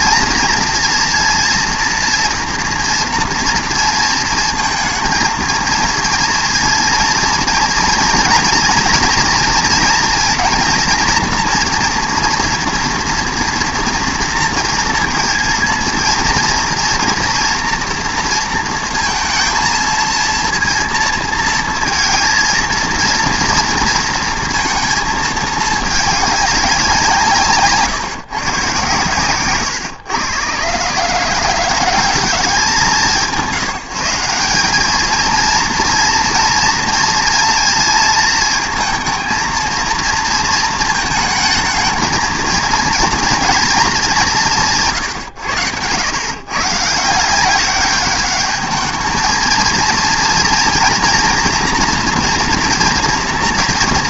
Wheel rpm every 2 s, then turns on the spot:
230, 230, 230, 230, 230, 230, 230, 230, 230, 230, 230, 230, 230, 190, 140, 120, 190, 200, 230, 230, 230, 230, 160, 140, 210, 230, 230.
none